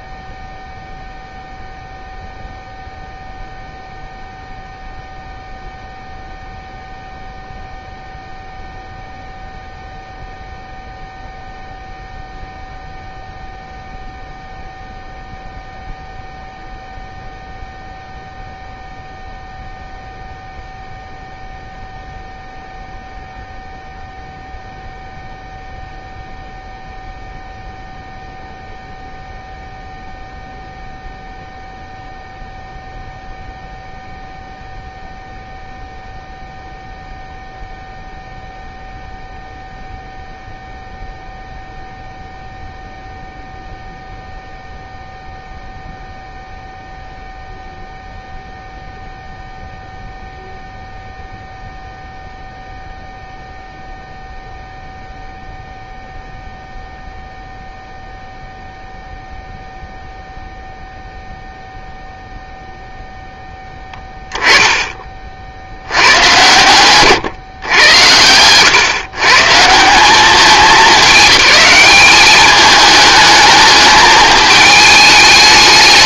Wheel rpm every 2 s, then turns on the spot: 0, 0, 0, 0, 0, 0, 0, 0, 0, 0, 0, 0, 0, 0, 0, 0, 0, 0, 0, 0, 0, 0, 0, 0, 0, 0, 0, 0, 0, 0, 0, 0, 10, 120, 130, 210, 210, 210.
none